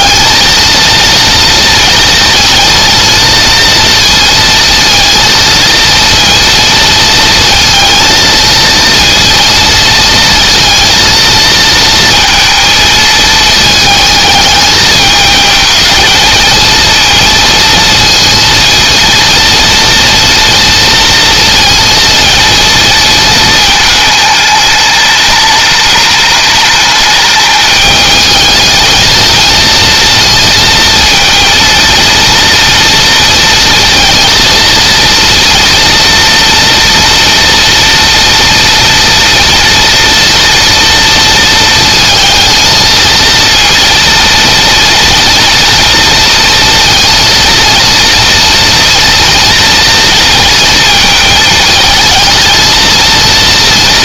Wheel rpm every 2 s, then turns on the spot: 230, 230, 230, 230, 230, 230, 220, 210, 220, 230, 230, 230, 210, 210, 220, 230, 230, 230, 240, 230, 230, 220, 230, 230, 230, 230, 230.
none